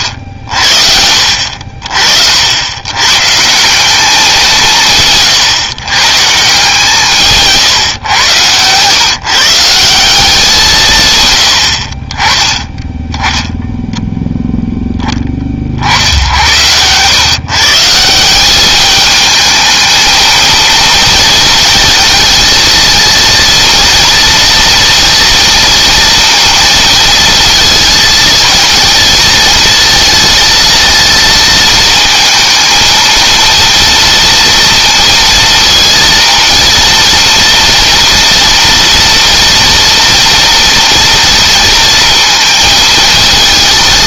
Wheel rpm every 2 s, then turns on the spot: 60, 90, 180, 150, 120, 180, 10, 0, 90, 200, 230, 230, 230, 230, 220, 220, 220, 230, 230, 230, 230, 230.
none